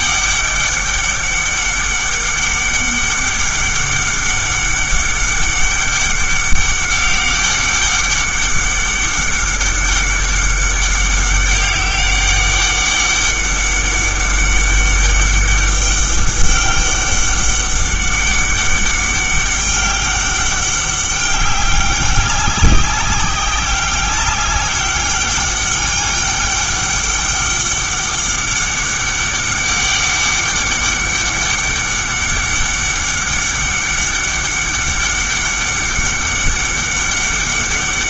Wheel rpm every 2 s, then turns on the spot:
200, 200, 200, 200, 200, 200, 200, 200, 200, 200, 200, 190, 200, 200, 200, 200, 200, 200, 200.
none